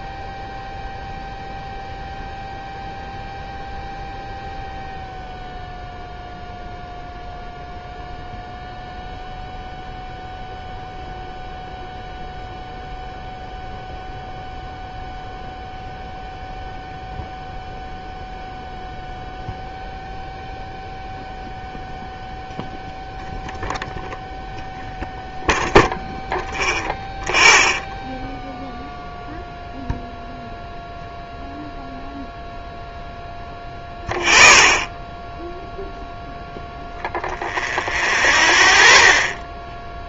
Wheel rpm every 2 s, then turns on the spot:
0, 0, 0, 0, 0, 0, 0, 0, 0, 0, 0, 0, 0, 0, 0, 0, 0, 0, 0, 0.
none